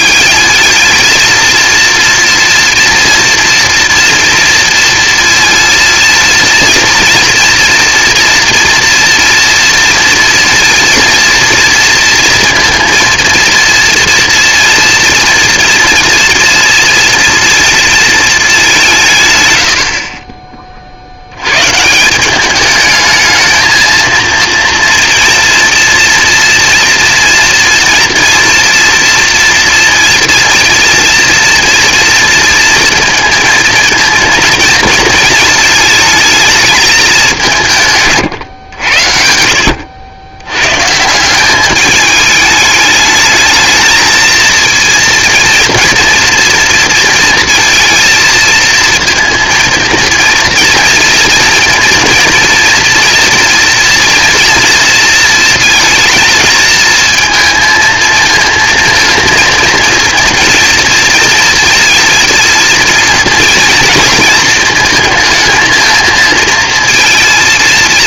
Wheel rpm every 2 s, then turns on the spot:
220, 230, 230, 230, 230, 230, 230, 230, 230, 200, 30, 200, 230, 240, 230, 230, 230, 230, 210, 100, 120, 210, 230, 230, 230, 230, 240, 230, 220, 230, 230, 230, 230, 230.
none